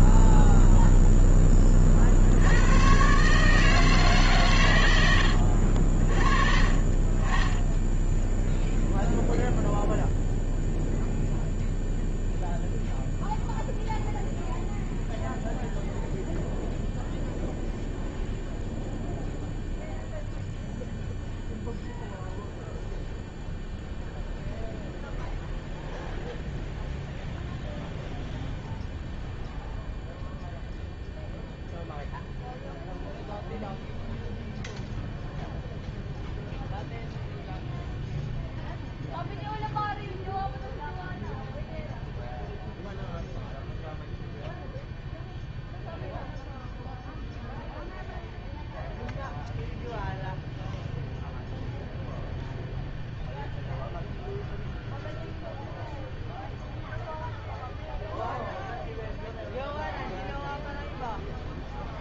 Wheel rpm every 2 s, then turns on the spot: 0, 100, 130, 40, 0, 0, 0, 0, 0, 0, 0, 0, 0, 0, 0, 0, 0, 0, 0, 0, 0, 0, 0, 0, 0, 0, 0, 0, 0, 0, 0.
none